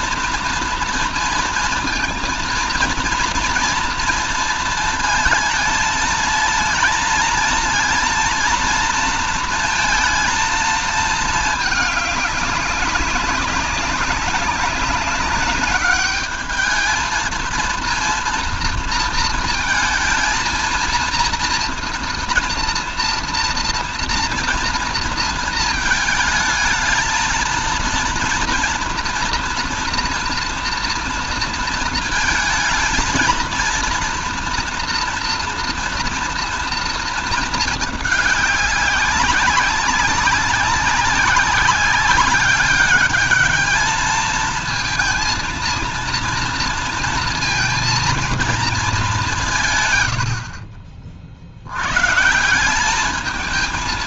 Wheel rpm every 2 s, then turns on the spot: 230, 230, 230, 230, 230, 230, 210, 190, 210, 230, 220, 230, 230, 220, 230, 240, 220, 230, 230, 200, 190, 200, 220, 230, 220, 70, 160.
none